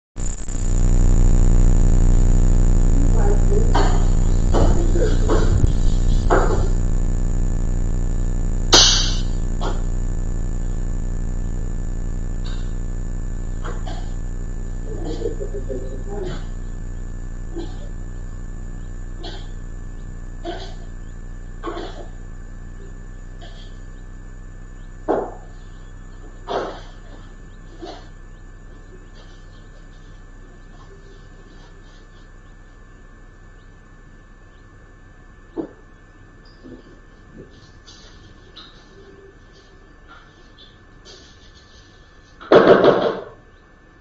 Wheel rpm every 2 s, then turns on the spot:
0, 0, 0, 0, 0, 0, 0, 0, 0, 0, 0, 0, 0, 0, 0, 0, 0, 0, 0, 0, 0, 0.
none